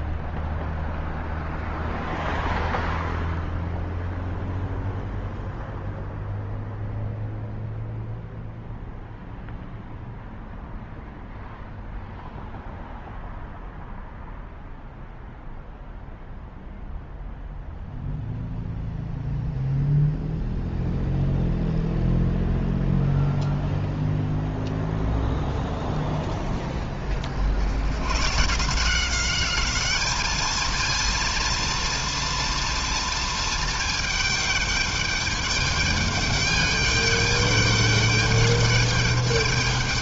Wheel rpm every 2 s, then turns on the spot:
0, 0, 0, 0, 0, 0, 0, 0, 0, 0, 0, 0, 0, 40, 190, 230, 230, 210, 210, 210.
none